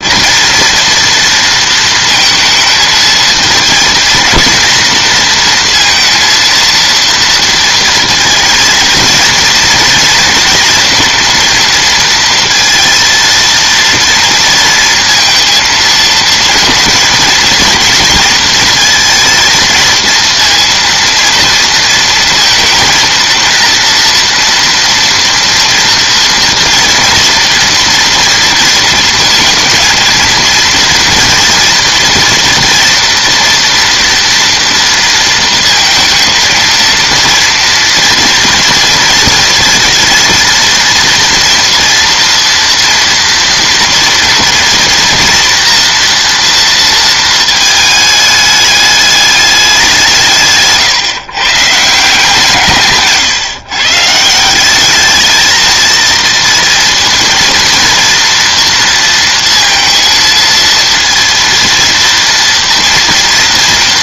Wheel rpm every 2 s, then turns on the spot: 240, 220, 230, 230, 230, 230, 230, 230, 220, 220, 230, 230, 230, 230, 230, 230, 230, 230, 230, 230, 230, 230, 230, 230, 210, 140, 150, 190, 230, 230, 230, 230.
50-52